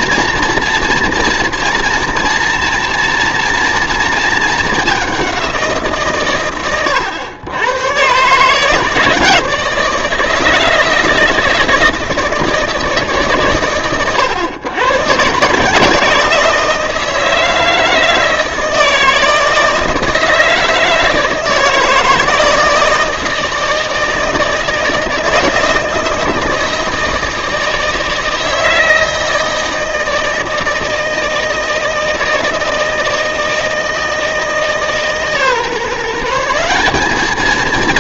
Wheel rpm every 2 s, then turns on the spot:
230, 230, 210, 110, 150, 160, 160, 110, 170, 160, 160, 160, 160, 160, 160, 160, 160, 160, 180.
none